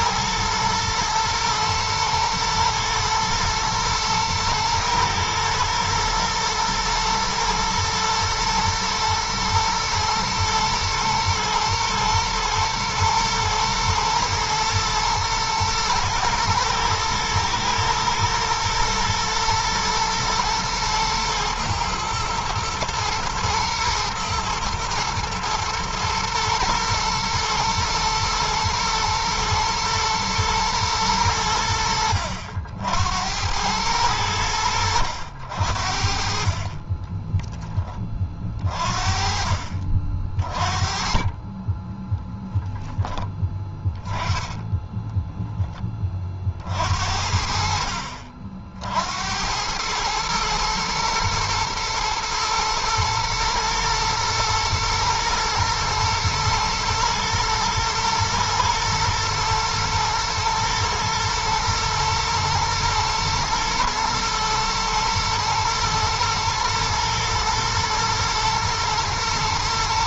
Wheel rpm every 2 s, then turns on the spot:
110, 110, 110, 110, 120, 110, 110, 110, 110, 110, 120, 120, 110, 120, 110, 110, 80, 80, 20, 40, 30, 10, 10, 60, 70, 110, 110, 110, 110, 110, 120, 120, 110, 110, 110.
36-38 44-46